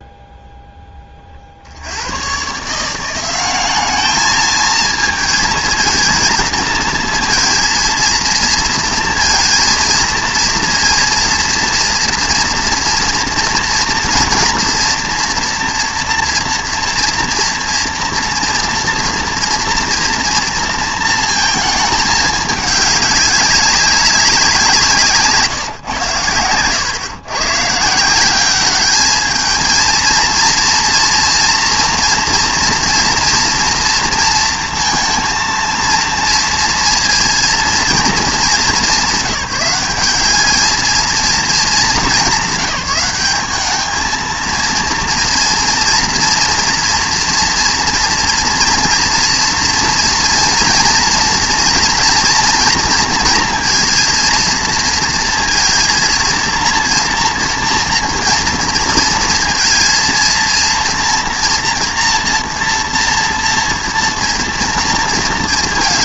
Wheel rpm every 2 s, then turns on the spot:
10, 160, 220, 230, 230, 230, 230, 230, 240, 230, 230, 210, 180, 110, 200, 230, 230, 230, 230, 200, 210, 190, 230, 230, 230, 230, 230, 230, 230, 230, 230, 230, 230.
none